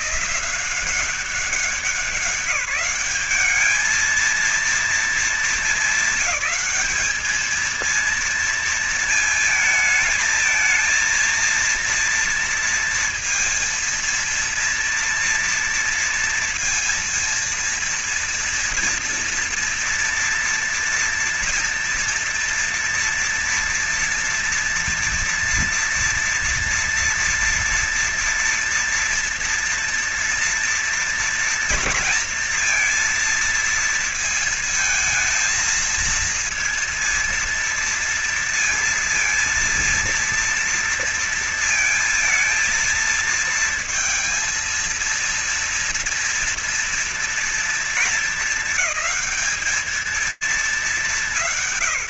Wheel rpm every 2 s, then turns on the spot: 190, 210, 220, 220, 220, 230, 230, 230, 230, 240, 230, 240, 230, 230, 230, 240, 230, 220, 230, 230, 230, 230, 230, 230, 210, 190.
none